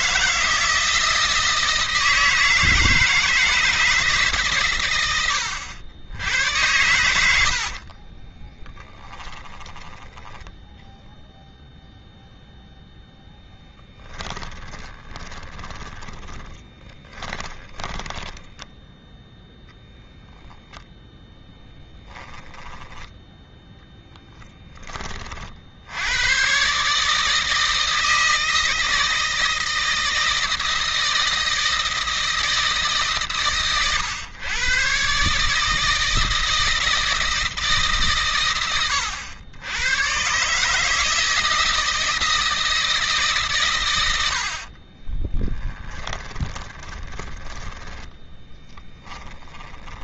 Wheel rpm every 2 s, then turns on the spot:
160, 160, 130, 90, 30, 0, 0, 20, 30, 20, 0, 10, 20, 140, 160, 160, 150, 130, 160, 110, 160, 160, 50, 20, 10.
8-10 14-18 44-50